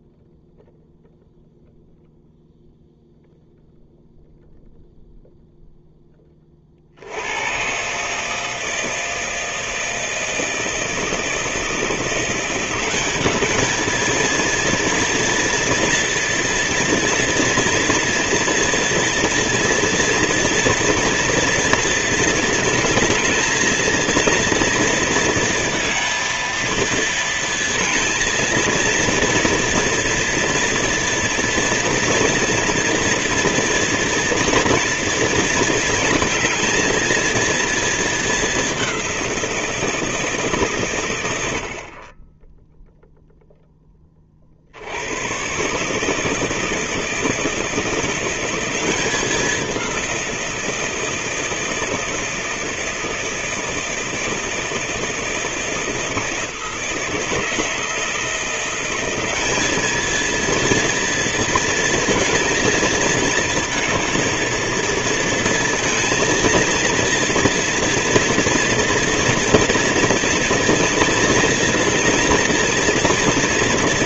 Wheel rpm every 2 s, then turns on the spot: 0, 0, 0, 40, 160, 160, 180, 230, 230, 230, 230, 220, 230, 230, 230, 240, 230, 230, 220, 200, 160, 0, 60, 150, 180, 170, 160, 160, 160, 170, 230, 230, 220, 230, 230, 230, 230.
none